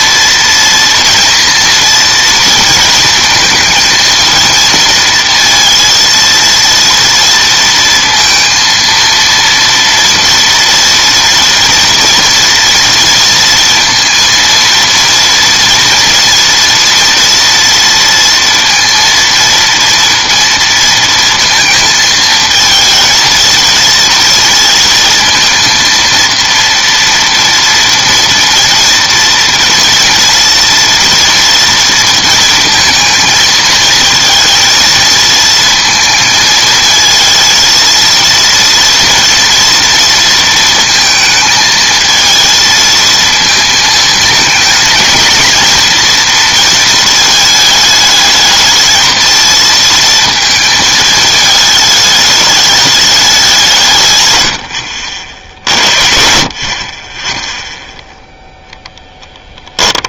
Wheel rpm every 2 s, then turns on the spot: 240, 220, 230, 230, 230, 230, 230, 230, 230, 230, 230, 230, 230, 230, 230, 240, 230, 230, 230, 240, 220, 230, 230, 220, 230, 220, 200, 60, 30, 10.
58-60